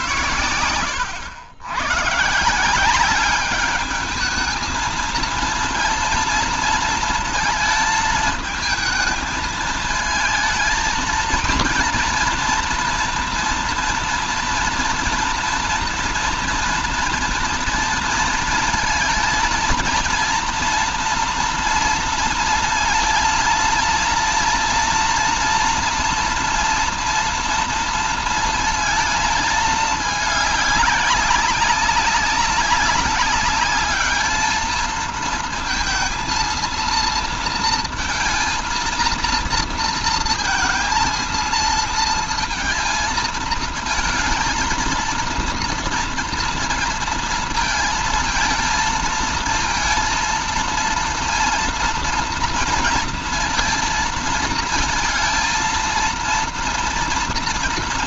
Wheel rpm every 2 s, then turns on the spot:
100, 170, 220, 230, 220, 230, 230, 230, 230, 220, 230, 230, 230, 230, 230, 210, 200, 210, 220, 230, 230, 230, 230, 230, 220, 230, 230, 230, 230.
none